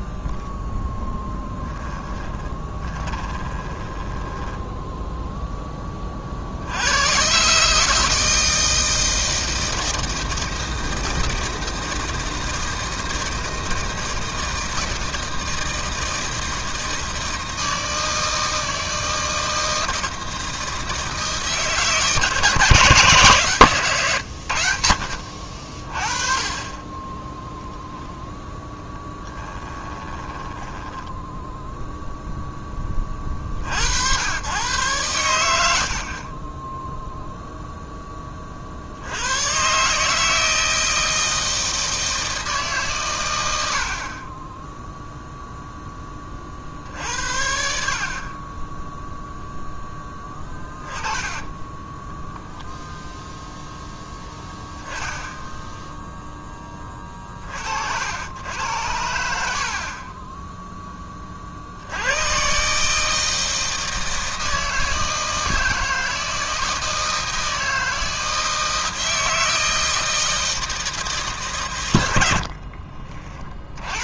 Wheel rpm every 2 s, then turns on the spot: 0, 20, 10, 80, 160, 160, 160, 160, 160, 160, 160, 160, 80, 20, 0, 10, 10, 120, 10, 50, 160, 150, 10, 50, 20, 20, 0, 10, 10, 80, 10, 140, 160, 160, 160, 160, 40.
2-6 30-32 72-74